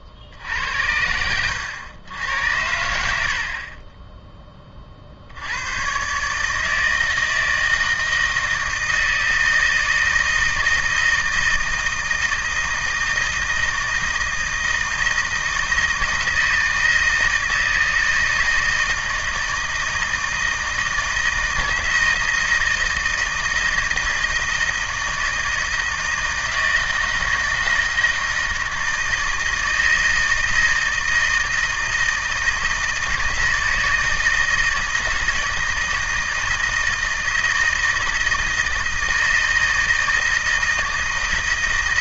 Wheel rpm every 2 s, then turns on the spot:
80, 80, 30, 160, 160, 160, 160, 160, 160, 160, 160, 160, 160, 160, 160, 160, 160, 160, 160, 160, 160.
none